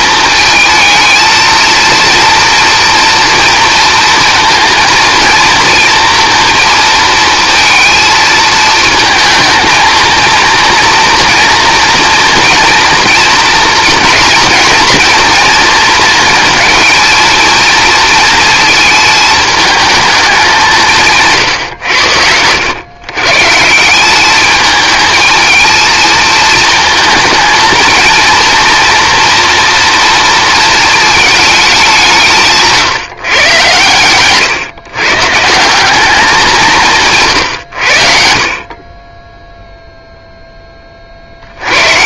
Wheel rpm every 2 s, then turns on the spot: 220, 230, 230, 230, 220, 230, 230, 230, 230, 220, 200, 120, 210, 220, 230, 230, 150, 130, 180, 50, 20.
none